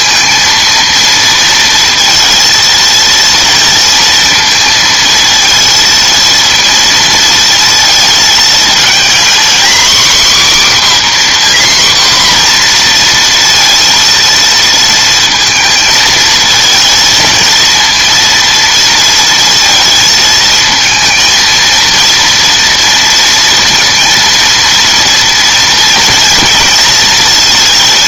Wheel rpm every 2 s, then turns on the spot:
230, 230, 230, 230, 220, 270, 240, 230, 220, 230, 220, 230, 230, 230.
none